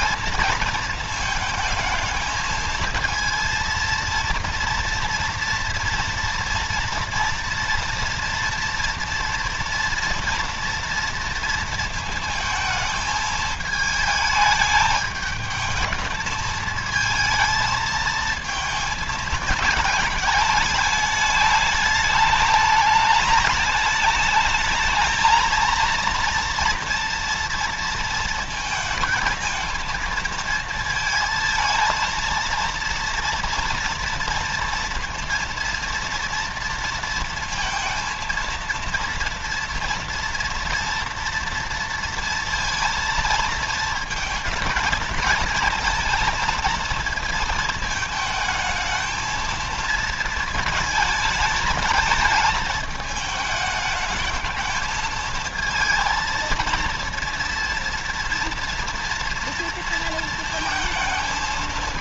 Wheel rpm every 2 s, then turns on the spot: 230, 230, 230, 230, 230, 230, 220, 220, 220, 220, 210, 210, 220, 230, 230, 230, 230, 230, 230, 230, 230, 230, 220, 230, 220, 220, 210, 220, 230, 230, 230.
none